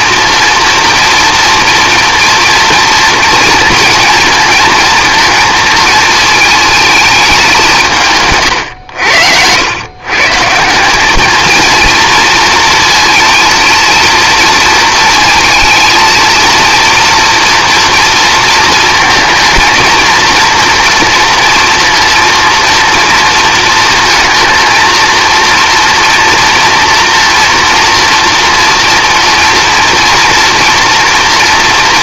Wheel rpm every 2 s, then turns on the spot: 230, 230, 230, 220, 90, 200, 230, 230, 230, 220, 230, 230, 230, 230, 230, 230.
none